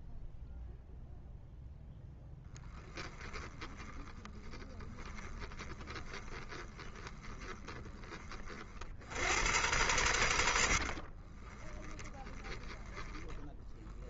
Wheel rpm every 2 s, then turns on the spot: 0, 10, 20, 20, 50, 90, 10.
2-8 10-14